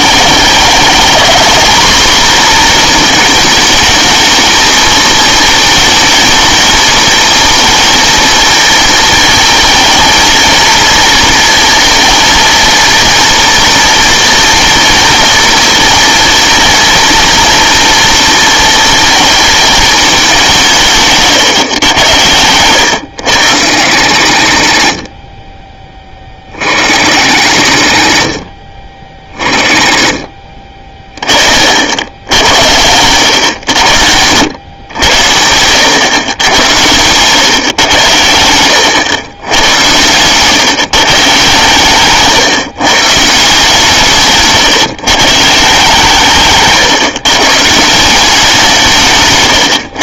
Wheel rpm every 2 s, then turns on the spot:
210, 240, 220, 220, 220, 220, 230, 240, 230, 230, 180, 100, 70, 50, 40, 30, 90, 100, 100, 100, 130, 140, 150, 150, 170.
22-24 30-32 38-40 46-48